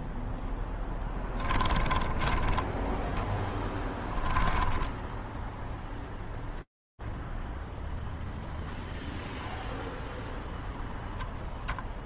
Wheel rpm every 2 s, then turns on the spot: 0, 10, 10, 0, 0, 0.
2-6